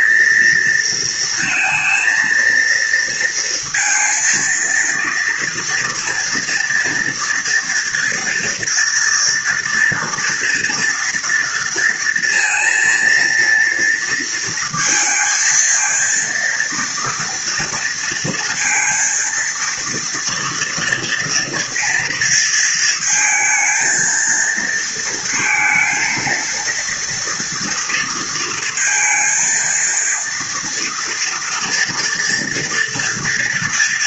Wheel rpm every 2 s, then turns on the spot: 230, 230, 230, 240, 230, 230, 230, 230, 230, 230, 230, 230, 230, 230, 230, 230, 230.
none